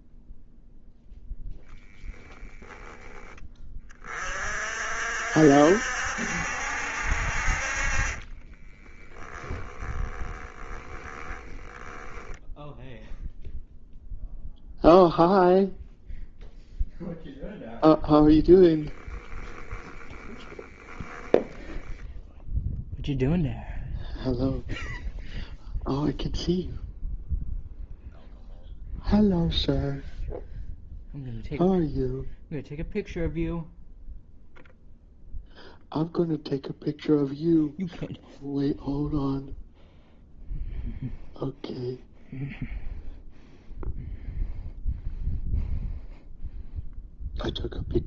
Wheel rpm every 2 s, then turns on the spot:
0, 20, 50, 60, 10, 10, 0, 0, 0, 10, 10, 0, 0, 0, 0, 0, 0, 0, 0, 0, 0, 0, 0, 0.
2-4 8-12 18-20